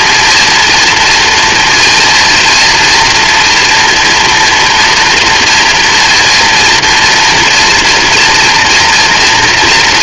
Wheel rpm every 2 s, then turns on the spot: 240, 240, 230, 230, 230.
none